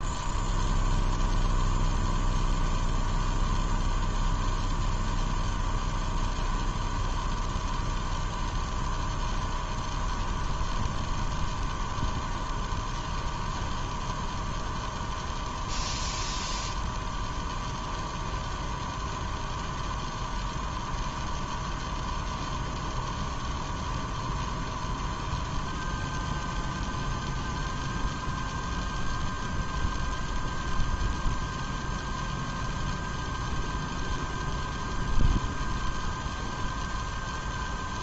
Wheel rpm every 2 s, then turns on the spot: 0, 0, 0, 0, 0, 0, 0, 0, 0, 0, 0, 0, 0, 0, 0, 0, 0, 0, 0.
none